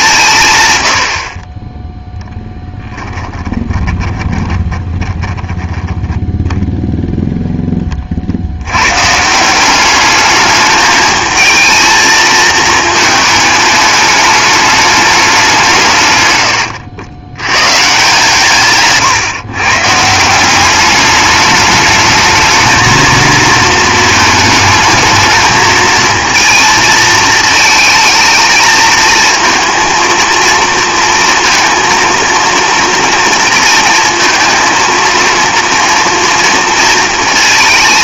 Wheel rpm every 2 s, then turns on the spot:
130, 10, 20, 0, 80, 210, 220, 210, 100, 150, 180, 220, 220, 230, 230, 230, 230, 230, 230.
2-6 16-18